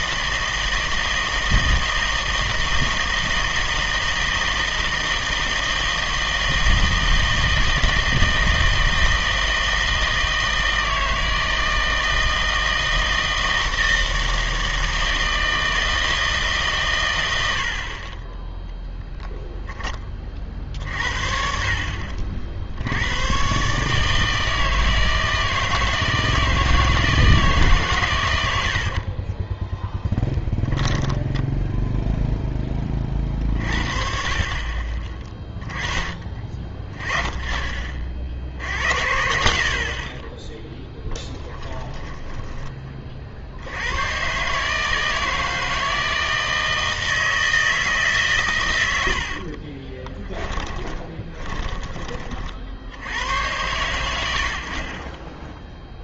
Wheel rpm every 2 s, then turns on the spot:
160, 160, 160, 160, 160, 160, 160, 160, 150, 10, 50, 70, 160, 160, 90, 10, 20, 30, 30, 70, 10, 20, 150, 160, 100, 20, 50, 60.
28-32 50-52